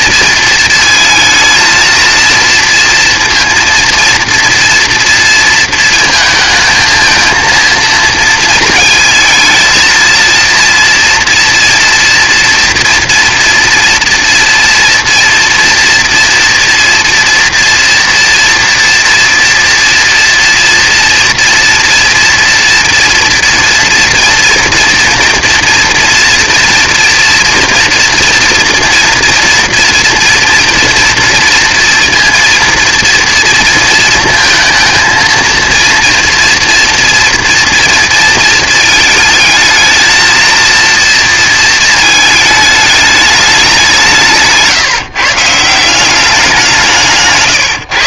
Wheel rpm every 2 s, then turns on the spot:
220, 230, 240, 220, 220, 230, 240, 230, 240, 230, 240, 230, 230, 230, 240, 230, 230, 230, 230, 220, 230, 210, 150, 170.
none